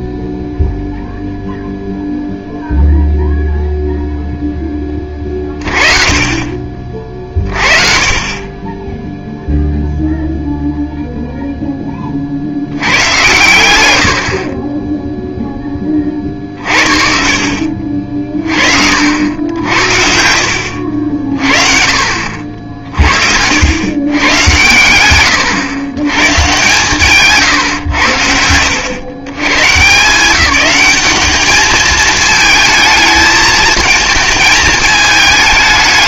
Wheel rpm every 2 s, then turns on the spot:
0, 0, 10, 30, 10, 0, 80, 20, 50, 50, 50, 50, 110, 140, 80, 180, 220, 220.
14-16